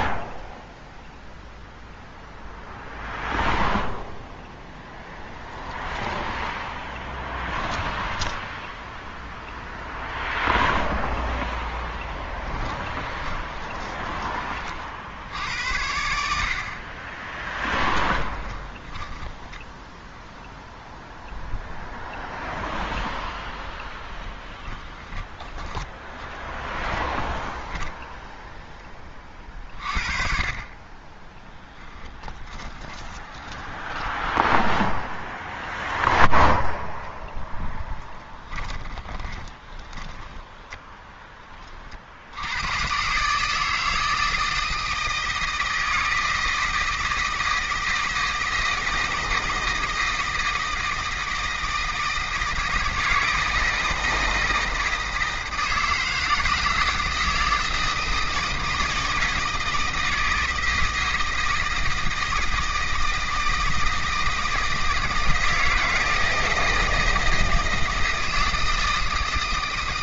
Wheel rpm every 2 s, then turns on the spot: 0, 0, 10, 10, 10, 0, 20, 40, 50, 30, 0, 0, 20, 20, 10, 40, 20, 0, 0, 20, 10, 110, 160, 160, 160, 160, 160, 160, 160, 160, 160, 160, 160, 160, 160.
6-8 12-14 18-20 24-28 32-34 38-40